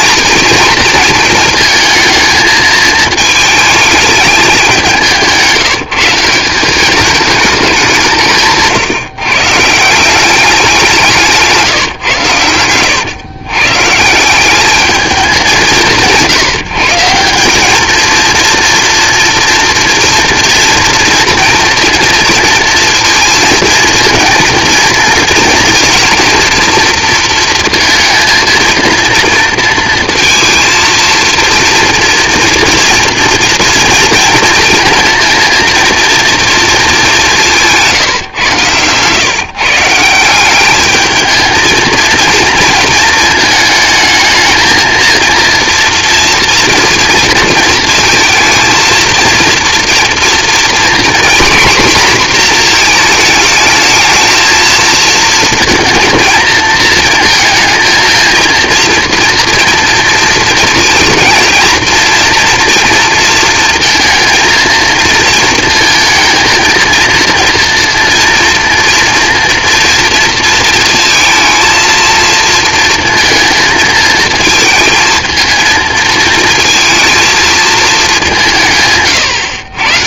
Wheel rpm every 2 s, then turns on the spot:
230, 220, 190, 200, 150, 190, 100, 200, 160, 230, 230, 230, 230, 230, 230, 230, 230, 230, 220, 120, 200, 230, 220, 230, 230, 240, 240, 220, 220, 230, 220, 230, 230, 230, 230, 230, 230, 230, 230, 150.
38-40